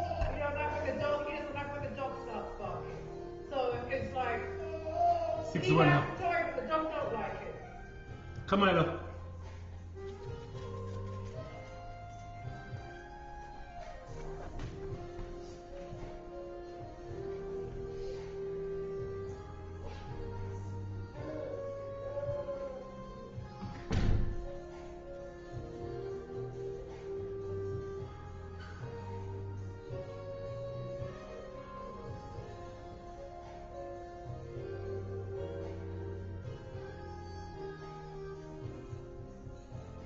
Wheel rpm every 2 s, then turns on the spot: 0, 0, 0, 0, 0, 0, 0, 0, 0, 0, 0, 0, 0, 0, 0, 0, 0, 0, 0, 0.
none